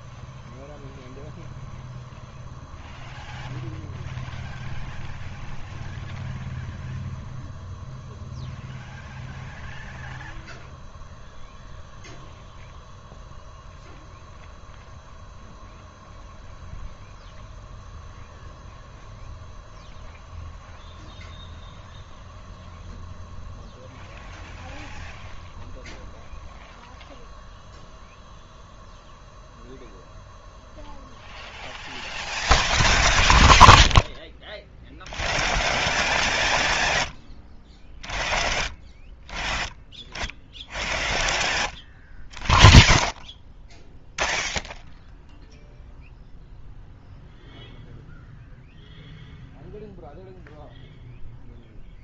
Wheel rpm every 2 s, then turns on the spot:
0, 0, 0, 0, 0, 0, 0, 0, 0, 0, 0, 0, 0, 0, 0, 0, 0, 0, 0, 0, 0, 0, 0, 0, 0, 0.
none